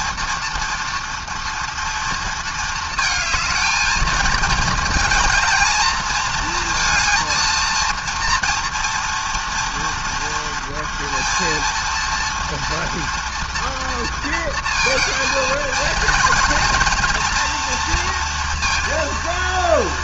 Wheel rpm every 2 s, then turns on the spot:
230, 220, 220, 230, 240, 230, 230, 230, 230, 230.
none